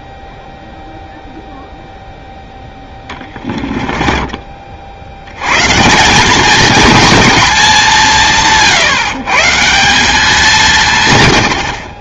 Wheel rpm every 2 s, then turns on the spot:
0, 10, 40, 220, 140, 160.
2-4